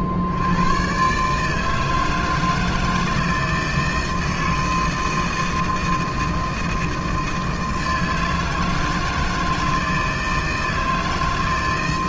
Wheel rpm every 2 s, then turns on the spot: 60, 160, 160, 160, 160, 160.
none